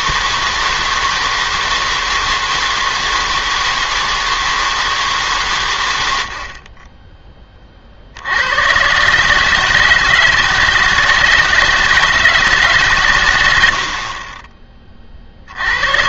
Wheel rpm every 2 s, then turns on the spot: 160, 160, 160, 40, 90, 160, 150, 20.
none